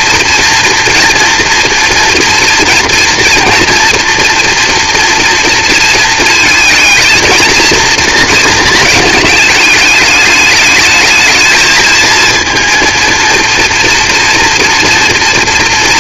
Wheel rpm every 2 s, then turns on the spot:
230, 230, 240, 220, 220, 210, 230, 230.
none